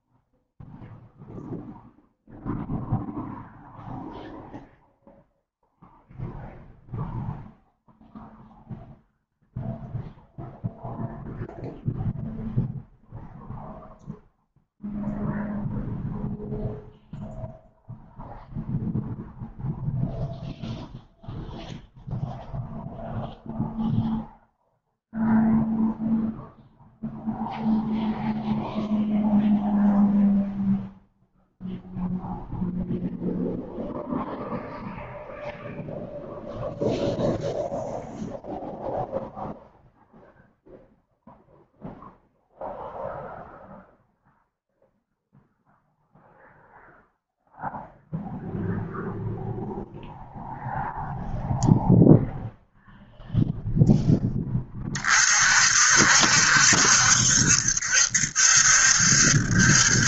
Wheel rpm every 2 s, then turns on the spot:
0, 0, 0, 0, 0, 0, 0, 0, 0, 0, 0, 0, 0, 0, 0, 0, 0, 0, 0, 0, 0, 0, 0, 0, 0, 0, 0, 30, 70, 70.
none